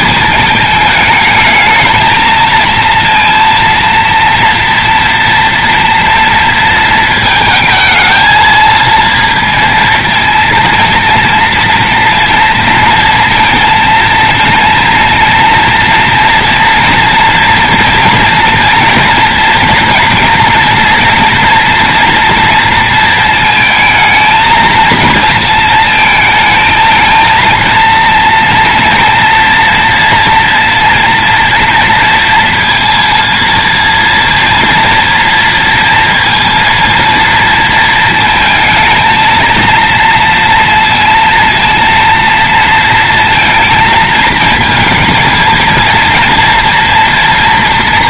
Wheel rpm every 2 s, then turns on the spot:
210, 230, 230, 230, 230, 230, 230, 230, 230, 240, 230, 230, 230, 220, 230, 230, 230, 230, 230, 220, 230, 230, 230, 230.
none